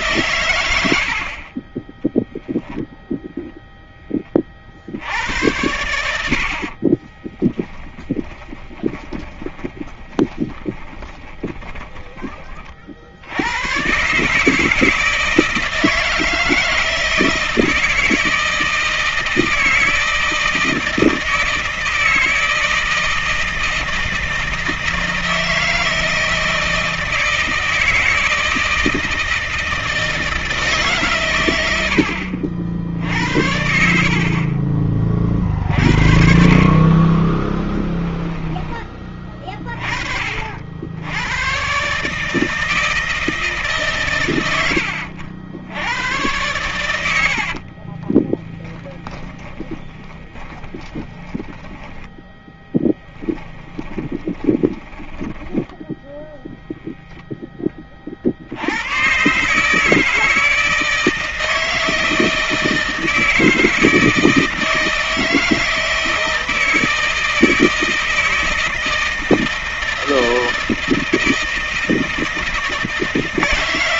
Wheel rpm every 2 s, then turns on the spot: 70, 0, 70, 40, 20, 20, 60, 160, 160, 160, 160, 160, 160, 160, 160, 130, 70, 40, 30, 20, 80, 160, 80, 80, 20, 30, 10, 10, 0, 110, 160, 160, 160, 160, 160, 160, 160.
6-12 46-56